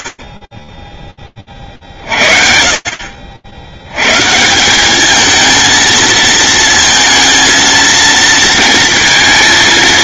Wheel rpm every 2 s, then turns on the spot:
10, 50, 200, 230, 220.
none